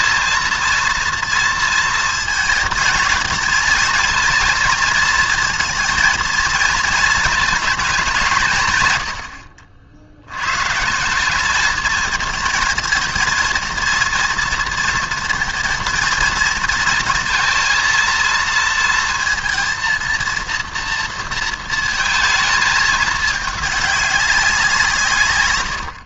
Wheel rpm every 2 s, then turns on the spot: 230, 230, 230, 230, 150, 120, 230, 230, 220, 230, 240, 220, 170.
none